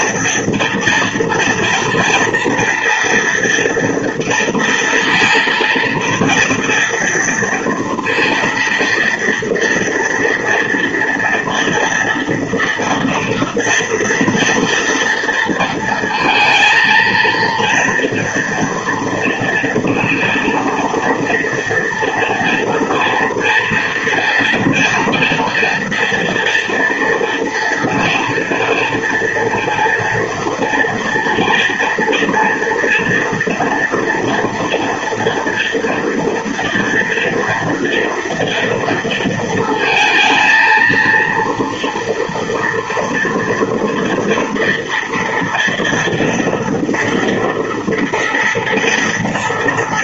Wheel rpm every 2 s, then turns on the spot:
240, 230, 230, 230, 230, 240, 230, 230, 220, 230, 230, 240, 230, 230, 230, 230, 240, 240, 230, 230, 230, 230, 230, 230, 240.
none